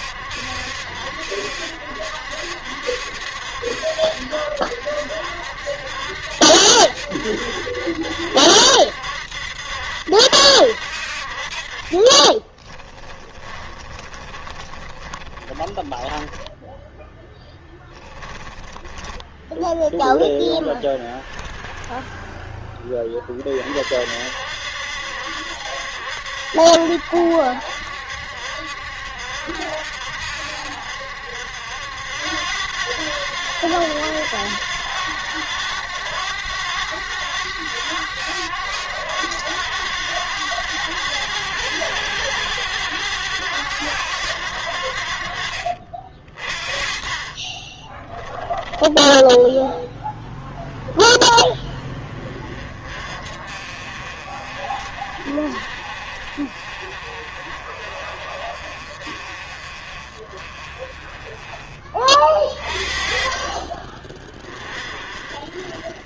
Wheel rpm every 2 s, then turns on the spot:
70, 70, 70, 70, 80, 70, 20, 20, 10, 10, 0, 10, 70, 70, 70, 70, 90, 90, 100, 100, 100, 100, 80, 30, 10, 10, 30, 40, 40, 40, 30, 30, 30.
12-20